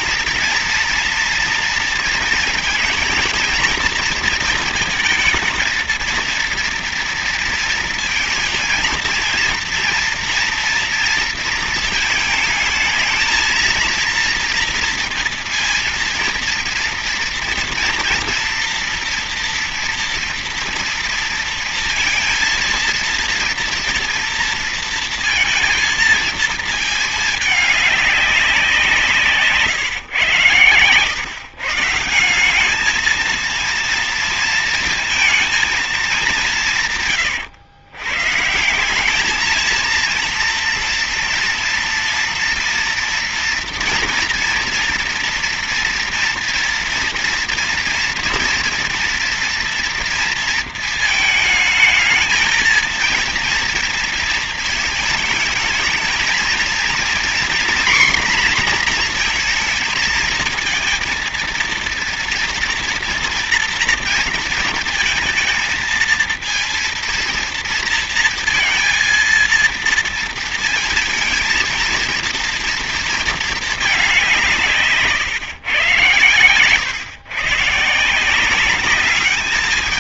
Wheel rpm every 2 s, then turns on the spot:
240, 220, 230, 230, 230, 230, 220, 230, 230, 230, 230, 230, 230, 220, 180, 120, 190, 230, 180, 160, 230, 230, 230, 230, 230, 230, 230, 220, 230, 240, 220, 230, 230, 230, 230, 230, 230, 170, 120, 180.
none